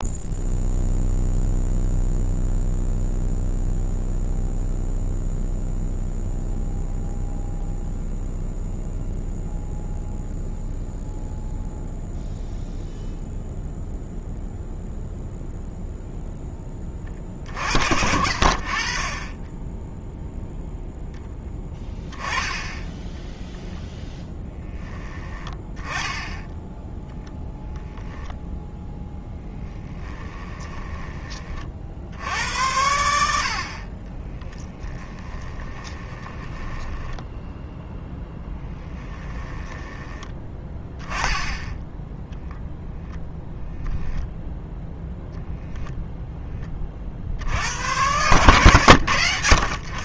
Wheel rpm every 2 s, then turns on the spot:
0, 0, 0, 0, 0, 0, 0, 0, 20, 40, 0, 10, 10, 0, 0, 10, 80, 10, 10, 10, 10, 0, 0, 40, 100.
30-32 34-40